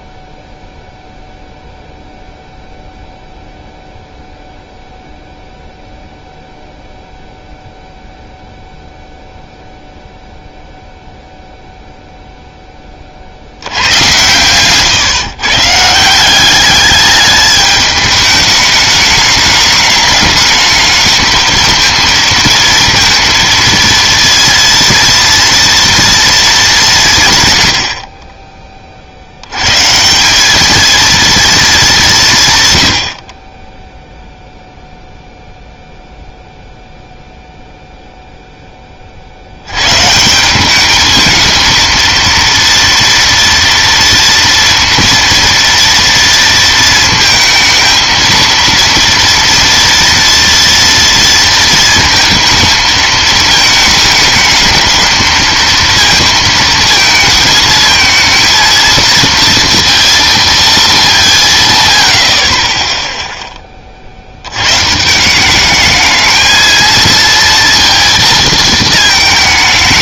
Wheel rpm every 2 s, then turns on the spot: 0, 0, 0, 0, 0, 0, 10, 130, 200, 210, 210, 230, 230, 220, 30, 210, 120, 0, 0, 10, 190, 230, 230, 230, 230, 230, 220, 210, 230, 230, 230, 30, 110, 220, 220.
none